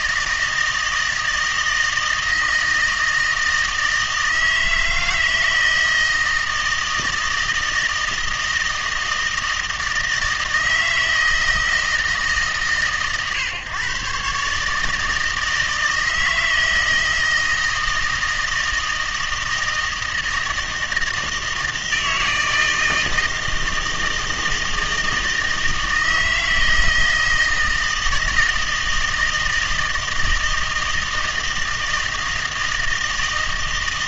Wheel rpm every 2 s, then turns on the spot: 160, 160, 160, 160, 160, 160, 140, 150, 160, 160, 160, 160, 160, 160, 160, 160, 160.
none